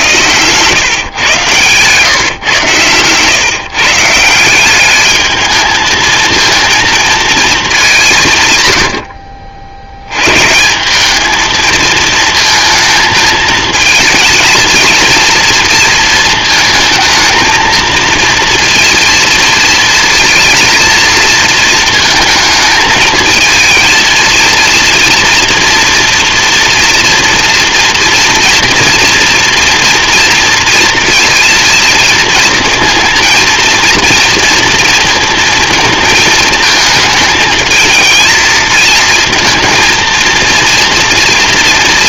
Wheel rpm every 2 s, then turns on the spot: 130, 120, 200, 230, 100, 180, 220, 230, 220, 230, 230, 220, 230, 230, 230, 230, 230, 230, 220, 220, 230.
none